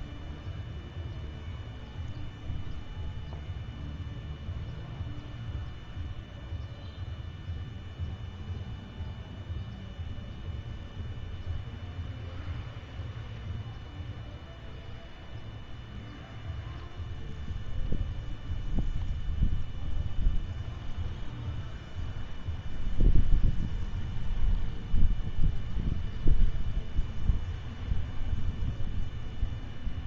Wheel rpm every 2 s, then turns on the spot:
0, 0, 0, 0, 0, 0, 0, 0, 0, 0, 0, 0, 0, 0, 0.
none